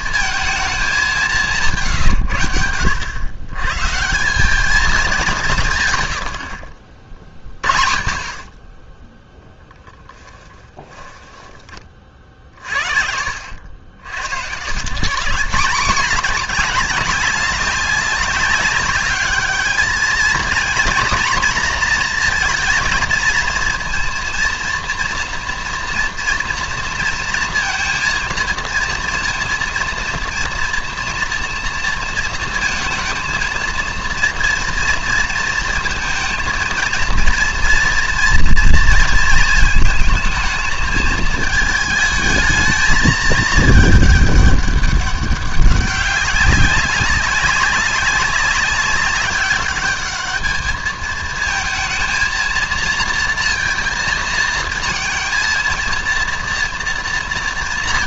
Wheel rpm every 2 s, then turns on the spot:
210, 90, 210, 60, 20, 20, 60, 120, 210, 200, 240, 230, 230, 230, 230, 230, 230, 230, 230, 230, 220, 220, 200, 190, 200, 220, 230, 230, 230.
10-12